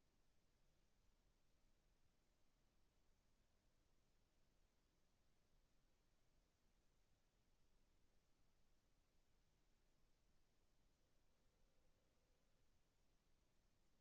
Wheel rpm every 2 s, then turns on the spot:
0, 0, 0, 0, 0, 10, 10.
12-14